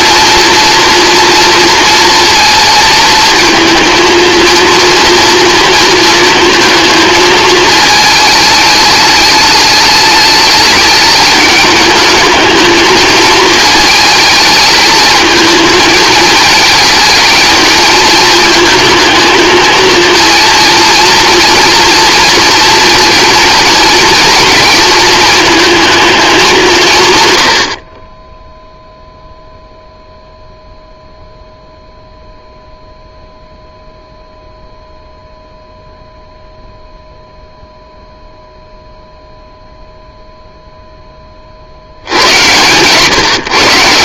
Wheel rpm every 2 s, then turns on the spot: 230, 230, 230, 220, 210, 210, 230, 230, 220, 220, 230, 230, 230, 90, 0, 0, 0, 0, 0, 0, 0, 120.
none